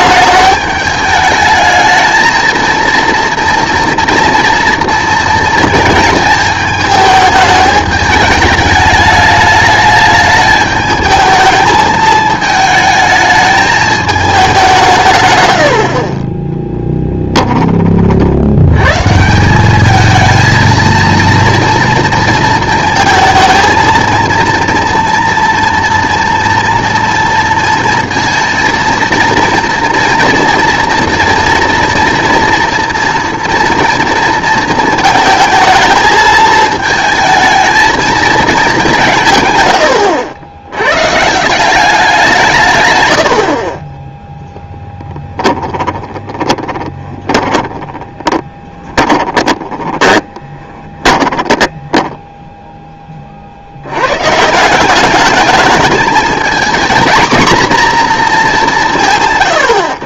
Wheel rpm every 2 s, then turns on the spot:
210, 230, 230, 220, 210, 220, 220, 180, 10, 110, 230, 220, 230, 230, 230, 230, 230, 230, 220, 200, 110, 120, 10, 20, 20, 20, 10, 180, 220, 180.
16-18 44-52